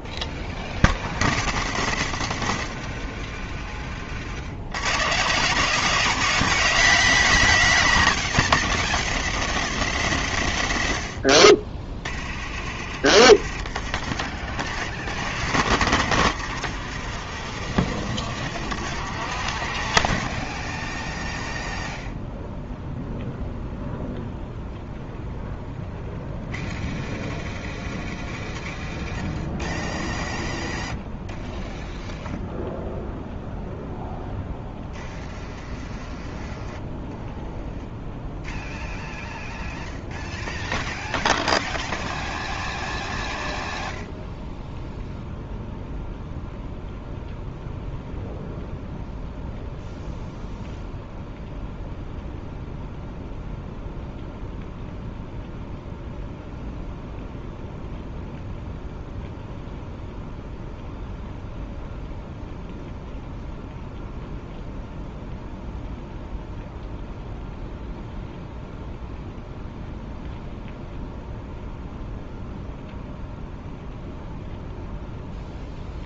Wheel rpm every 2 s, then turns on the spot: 0, 0, 150, 160, 10, 10, 40, 60, 90, 70, 0, 0, 0, 0, 0, 0, 0, 0, 0, 0, 0, 0, 0, 0, 0, 0, 0, 0, 0, 0, 0, 0, 0, 0, 0, 0, 0, 0.
14-20